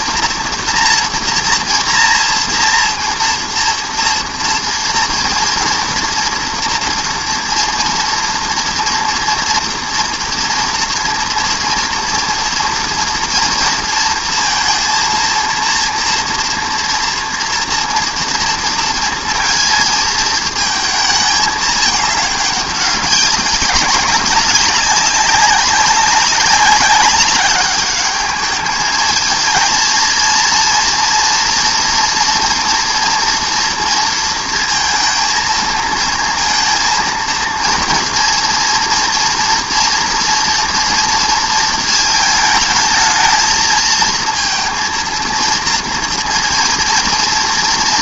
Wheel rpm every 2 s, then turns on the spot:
230, 230, 230, 230, 240, 230, 230, 240, 230, 230, 230, 210, 200, 190, 200, 220, 230, 230, 230, 230, 230, 230, 220, 230.
none